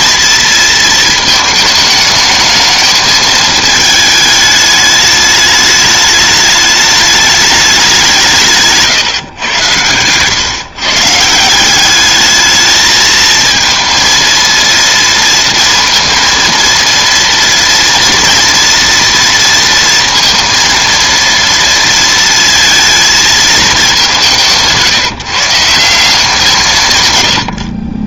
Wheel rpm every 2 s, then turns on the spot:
220, 210, 210, 210, 160, 130, 220, 230, 230, 230, 230, 230, 170, 160.
none